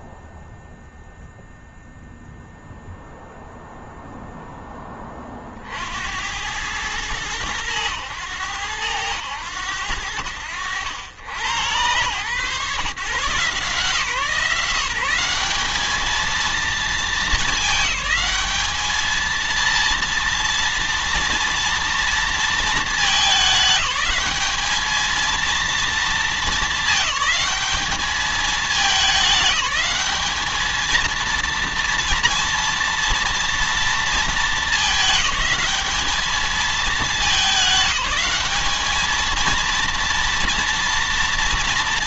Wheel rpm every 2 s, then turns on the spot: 0, 0, 30, 110, 100, 90, 120, 180, 220, 220, 230, 210, 220, 210, 210, 220, 230, 210, 210, 220, 230.
none